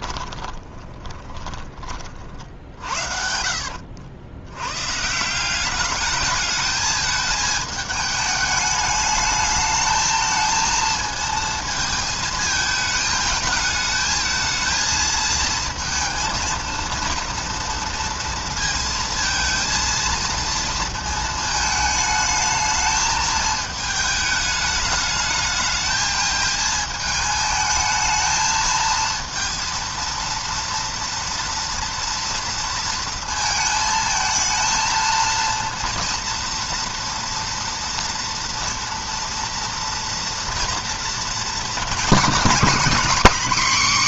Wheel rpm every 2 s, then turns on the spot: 20, 50, 100, 220, 210, 220, 220, 220, 230, 230, 230, 220, 210, 220, 220, 230, 230, 220, 230, 240, 230, 230.
0-4